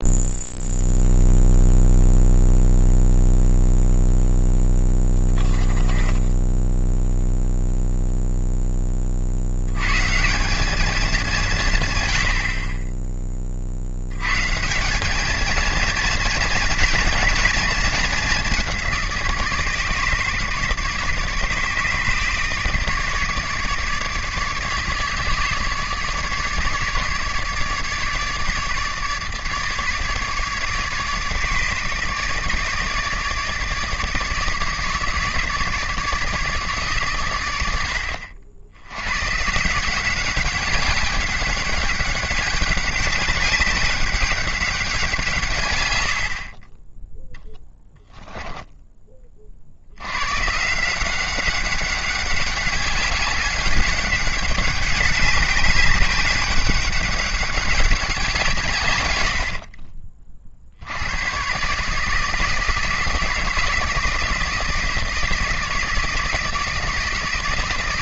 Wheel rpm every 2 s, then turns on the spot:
0, 0, 10, 0, 10, 210, 10, 180, 230, 190, 150, 150, 150, 150, 150, 150, 150, 160, 150, 80, 200, 190, 190, 30, 10, 160, 200, 200, 200, 150, 70, 160, 160, 160.
none